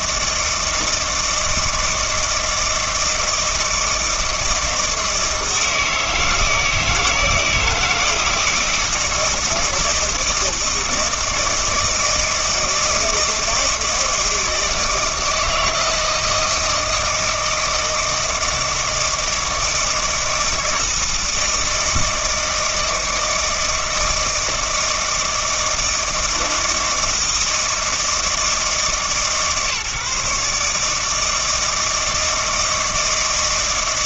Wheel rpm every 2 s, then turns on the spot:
160, 160, 160, 160, 160, 160, 160, 160, 160, 160, 160, 160, 160, 160, 160, 150, 160.
none